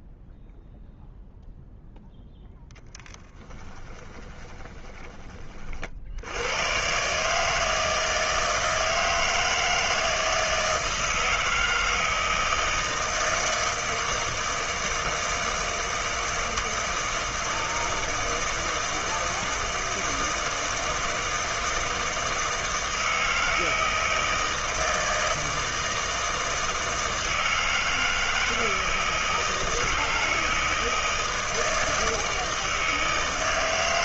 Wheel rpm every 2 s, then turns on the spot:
0, 10, 20, 80, 160, 160, 160, 160, 160, 160, 160, 160, 160, 160, 160, 160, 160.
4-6